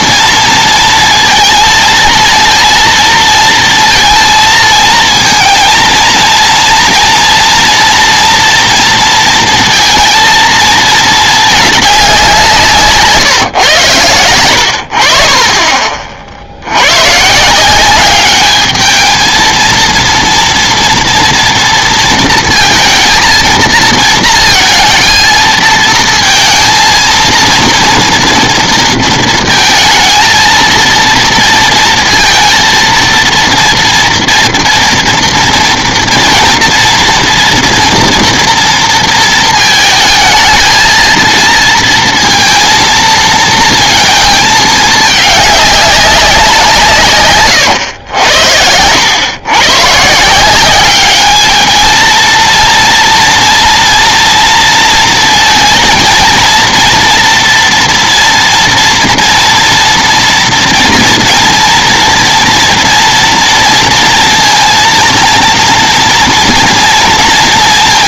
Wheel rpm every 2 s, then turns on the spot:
230, 230, 230, 230, 230, 220, 170, 80, 80, 220, 230, 230, 230, 230, 230, 230, 230, 230, 230, 230, 220, 230, 210, 170, 80, 190, 230, 230, 230, 240, 230, 230, 230, 230.
none